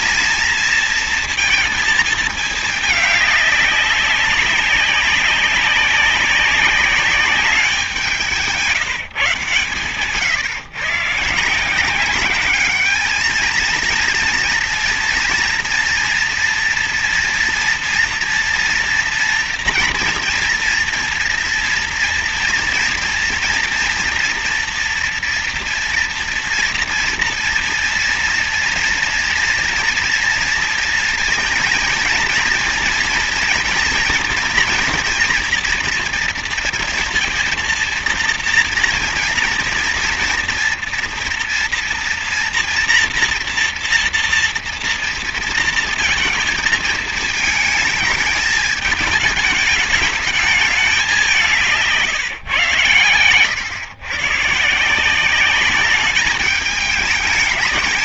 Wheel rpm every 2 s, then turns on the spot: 230, 210, 200, 190, 150, 140, 210, 230, 230, 230, 240, 230, 230, 240, 230, 230, 230, 230, 230, 230, 230, 230, 230, 220, 210, 200, 110, 150, 210.
none